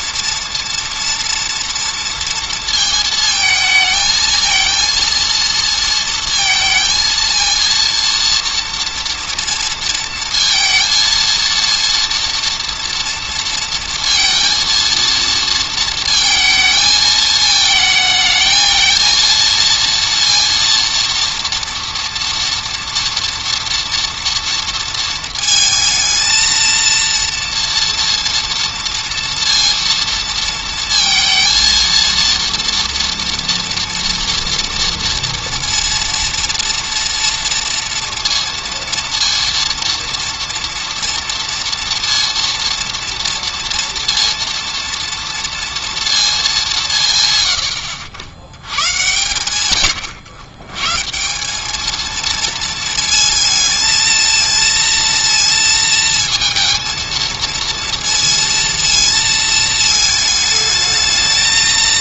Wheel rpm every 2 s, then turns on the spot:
230, 230, 230, 230, 230, 230, 230, 230, 220, 220, 230, 240, 230, 230, 230, 230, 230, 230, 230, 230, 230, 230, 230, 190, 100, 120, 230, 230, 230, 230, 220.
none